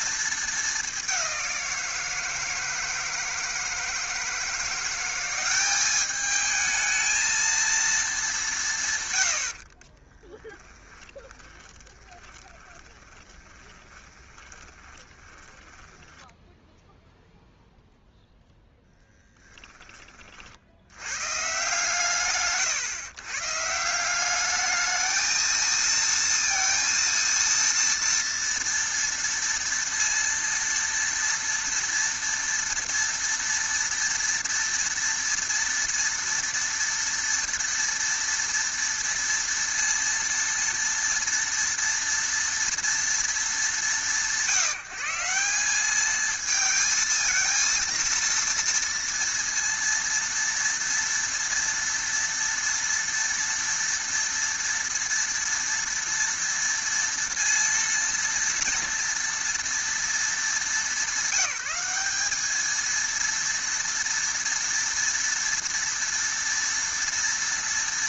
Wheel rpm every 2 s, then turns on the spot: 210, 160, 170, 220, 170, 10, 20, 20, 0, 0, 40, 110, 210, 230, 230, 230, 230, 230, 230, 230, 230, 230, 160, 220, 230, 230, 230, 230, 230, 230, 200, 210, 240, 230.
10-16